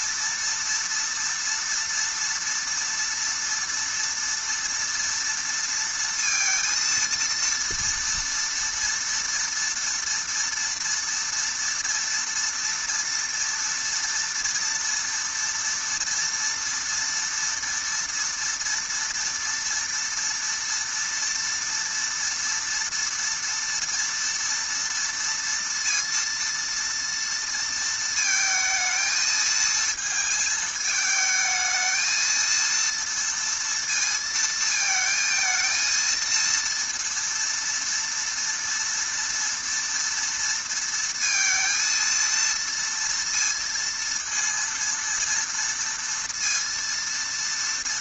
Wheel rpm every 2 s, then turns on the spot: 240, 230, 230, 230, 230, 230, 230, 230, 240, 230, 230, 230, 230, 230, 220, 220, 230, 230, 230, 230, 230, 230, 230, 230.
none